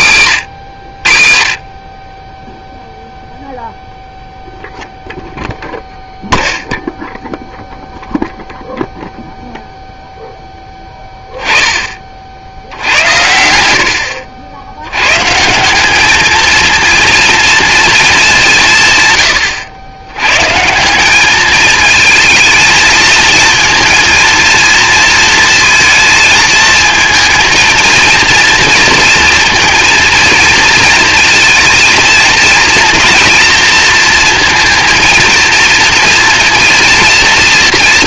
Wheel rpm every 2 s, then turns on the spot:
60, 0, 0, 0, 0, 10, 80, 90, 220, 160, 150, 230, 230, 220, 230, 230, 230, 230, 240.
none